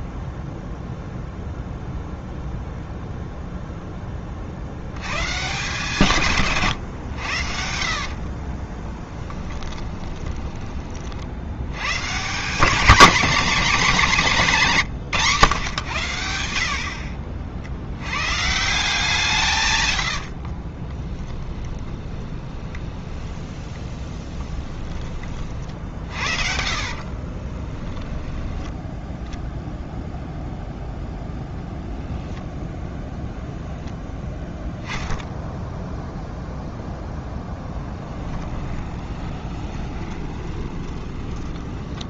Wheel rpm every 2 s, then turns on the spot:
0, 0, 50, 130, 40, 20, 190, 190, 70, 160, 40, 20, 10, 60, 10, 0, 0, 0, 0, 10, 20.
8-10 20-28 38-42